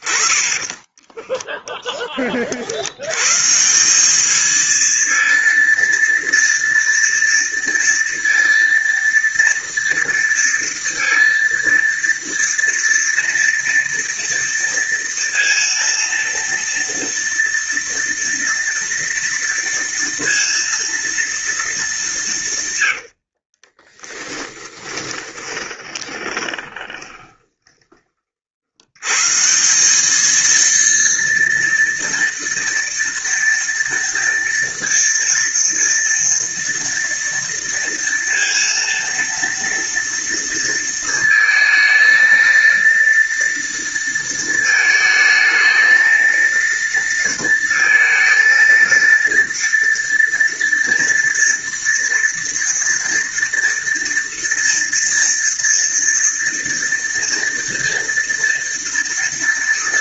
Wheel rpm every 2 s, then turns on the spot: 20, 80, 230, 230, 230, 230, 230, 230, 230, 230, 240, 100, 20, 20, 100, 230, 230, 230, 230, 230, 230, 230, 220, 230, 230, 230, 230, 230, 230, 230.
0-2 22-28